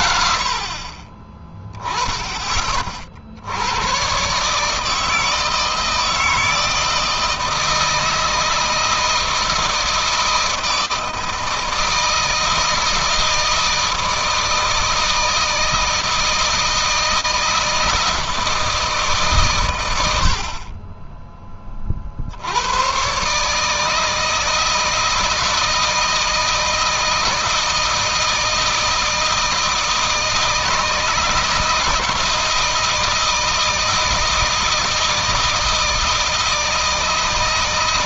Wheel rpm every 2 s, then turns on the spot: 20, 60, 160, 160, 160, 160, 160, 160, 160, 140, 20, 140, 160, 160, 160, 160, 160, 160, 160.
none